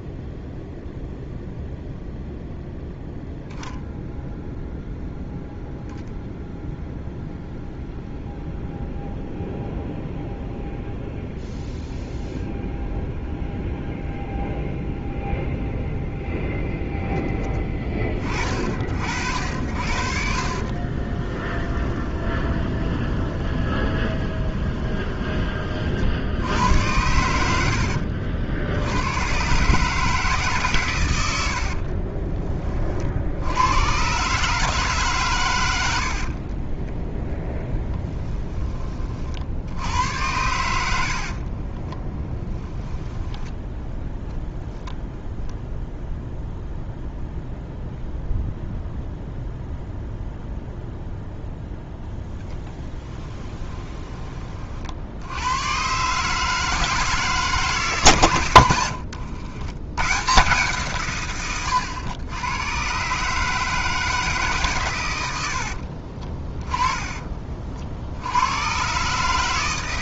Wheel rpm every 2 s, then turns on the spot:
0, 0, 0, 0, 0, 0, 0, 0, 0, 50, 40, 20, 20, 100, 80, 140, 40, 150, 20, 20, 80, 10, 0, 0, 0, 0, 10, 50, 160, 110, 140, 120, 130, 20, 120.
20-26 36-38 40-42 52-54 58-60 66-68